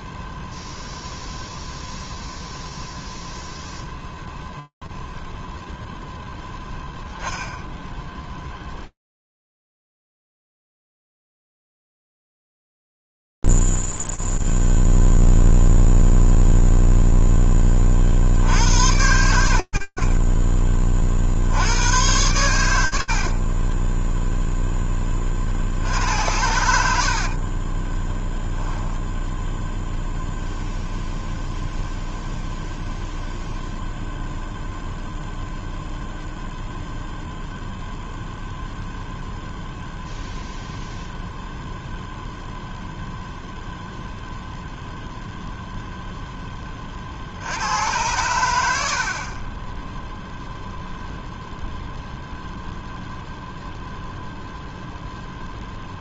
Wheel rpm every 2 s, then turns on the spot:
0, 0, 0, 0, 0, 0, 0, 0, 0, 40, 10, 70, 10, 80, 0, 0, 0, 0, 0, 0, 0, 0, 0, 70, 40, 0, 0, 0.
none